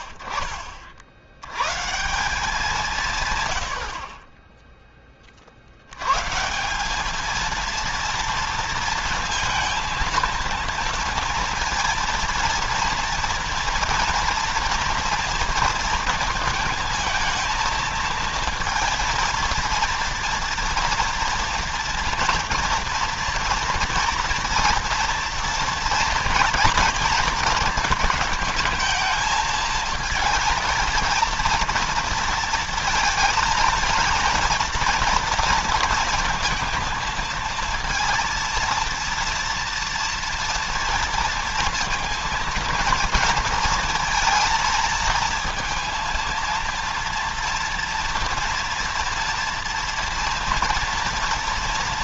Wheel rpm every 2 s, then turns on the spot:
50, 180, 10, 160, 230, 230, 240, 230, 230, 230, 230, 230, 230, 230, 220, 220, 230, 230, 230, 230, 230, 230, 230, 230, 230, 230.
none